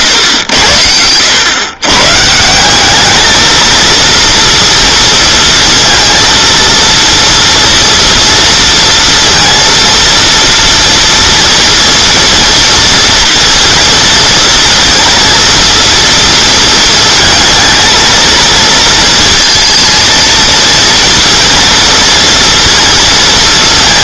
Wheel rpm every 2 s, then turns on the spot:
100, 180, 230, 230, 230, 230, 230, 230, 230, 230, 230, 230.
none